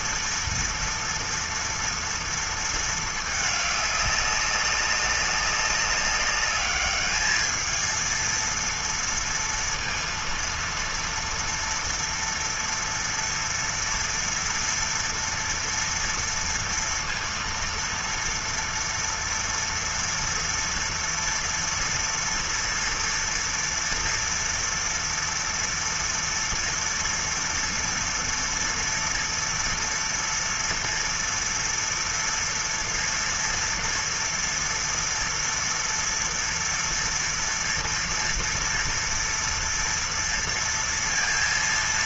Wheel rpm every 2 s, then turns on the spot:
230, 230, 200, 200, 220, 230, 230, 240, 230, 230, 230, 230, 230, 230, 230, 230, 230, 230, 230, 230, 230.
none